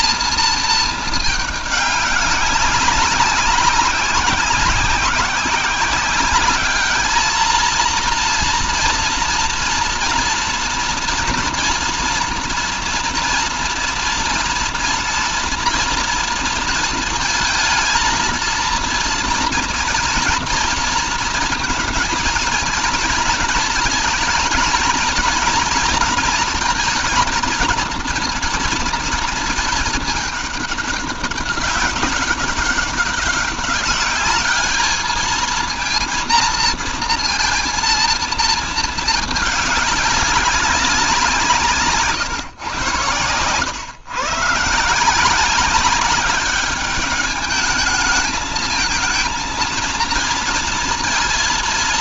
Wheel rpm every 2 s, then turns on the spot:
220, 200, 190, 200, 230, 230, 230, 230, 230, 230, 230, 230, 220, 220, 230, 200, 190, 210, 230, 220, 190, 110, 140, 200, 220, 230.
none